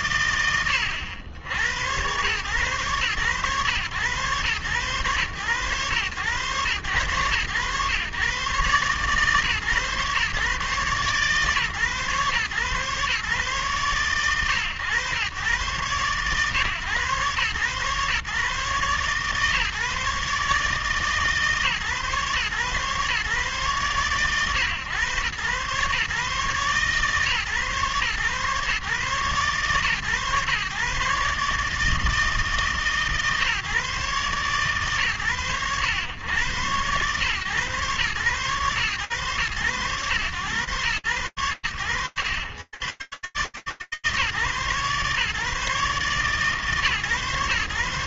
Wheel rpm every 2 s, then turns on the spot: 100, 110, 120, 100, 130, 130, 130, 120, 130, 140, 150, 130, 120, 130, 140, 130, 140, 120, 120, 120, 100, 140, 140, 140.
none